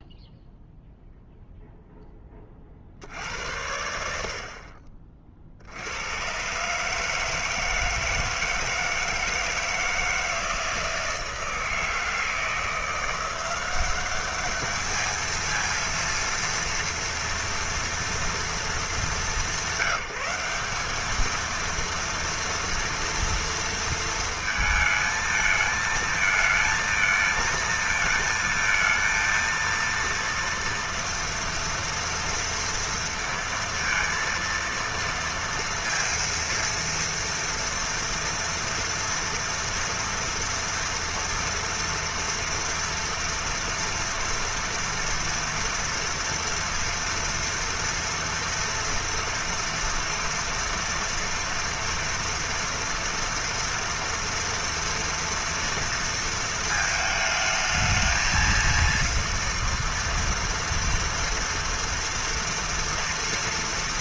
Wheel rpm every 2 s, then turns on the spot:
0, 30, 50, 130, 160, 160, 160, 210, 230, 220, 190, 230, 230, 220, 230, 230, 230, 230, 230, 230, 230, 230, 230, 230, 230, 230, 230, 230, 220, 230, 230, 230.
none